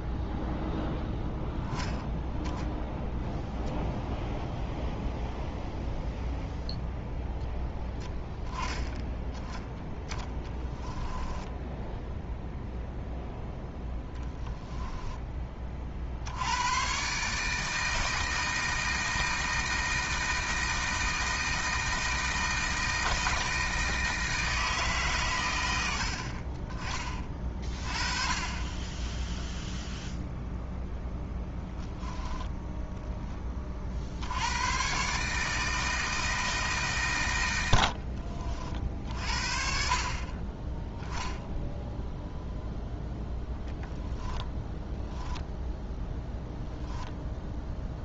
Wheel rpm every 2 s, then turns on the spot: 0, 0, 0, 0, 10, 20, 0, 10, 120, 160, 160, 160, 140, 30, 20, 0, 10, 120, 150, 40, 10, 0, 10, 0.
10-12